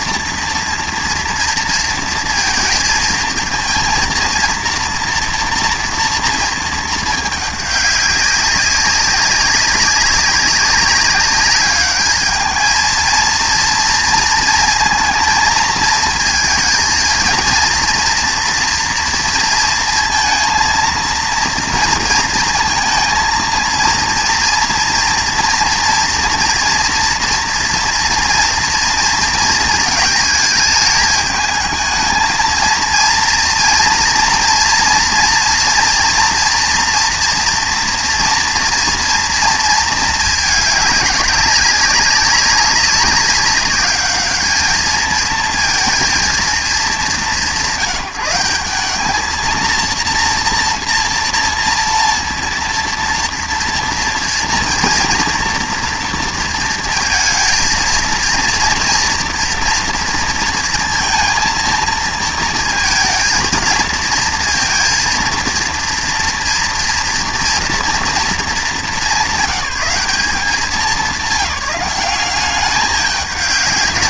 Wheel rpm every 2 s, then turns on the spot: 230, 230, 230, 220, 190, 190, 220, 230, 220, 240, 230, 230, 230, 230, 230, 210, 230, 230, 230, 230, 210, 200, 210, 210, 200, 230, 230, 230, 220, 230, 230, 230, 230, 230, 210, 190, 200.
none